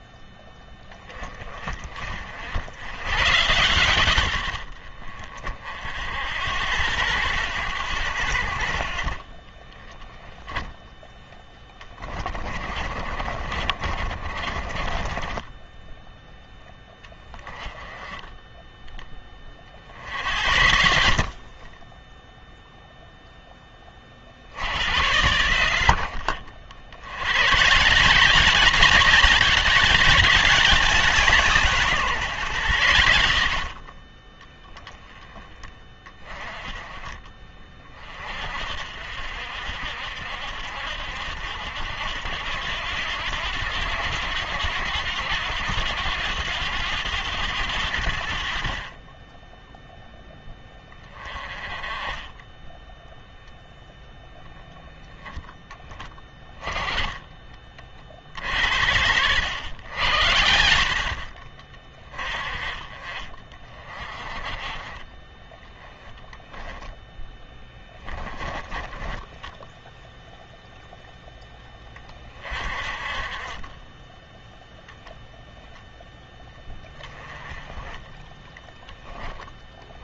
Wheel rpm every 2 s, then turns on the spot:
20, 100, 50, 90, 50, 10, 40, 30, 20, 10, 70, 0, 80, 80, 190, 180, 100, 10, 30, 60, 70, 90, 90, 100, 40, 10, 0, 0, 10, 70, 60, 40, 30, 10, 10, 0, 40, 0, 10, 10.
12-16 66-70